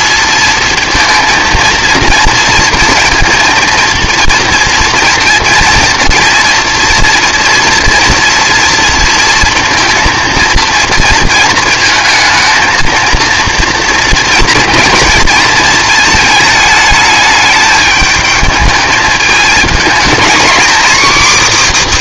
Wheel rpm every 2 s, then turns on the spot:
230, 230, 230, 230, 230, 220, 230, 230, 210, 220, 290.
none